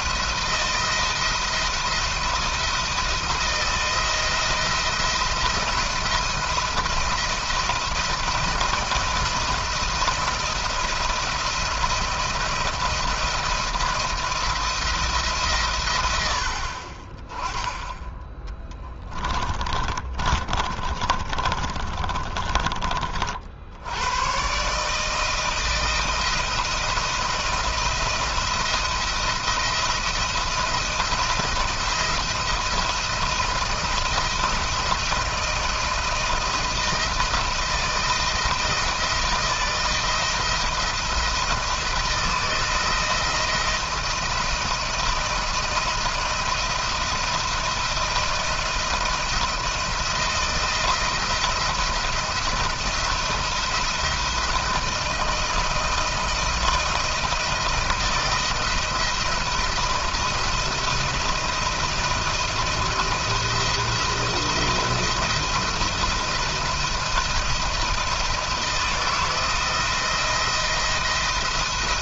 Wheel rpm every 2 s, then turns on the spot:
160, 170, 170, 170, 170, 170, 170, 170, 40, 20, 30, 30, 140, 170, 170, 170, 170, 160, 170, 160, 160, 170, 170, 160, 170, 170, 170, 170, 160, 170, 170, 170, 170, 170, 170, 170.
18-22